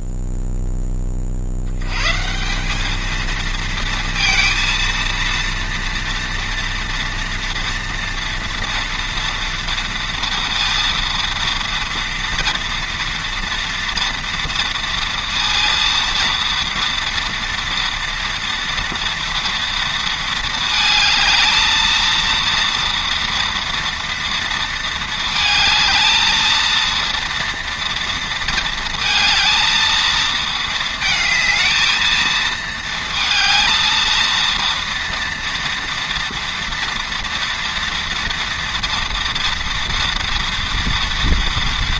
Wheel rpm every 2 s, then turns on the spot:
10, 190, 230, 230, 230, 230, 230, 230, 230, 230, 220, 230, 230, 230, 230, 220, 220, 230, 230, 240, 230.
none